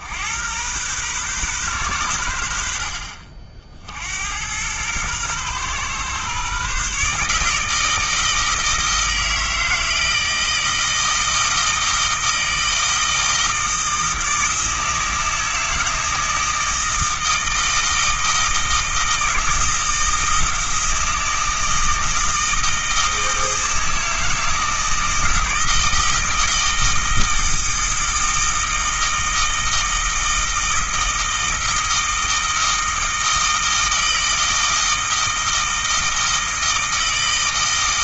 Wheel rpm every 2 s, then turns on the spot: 120, 60, 110, 140, 160, 160, 160, 160, 160, 160, 160, 160, 160, 160, 160, 160, 160, 160, 160.
none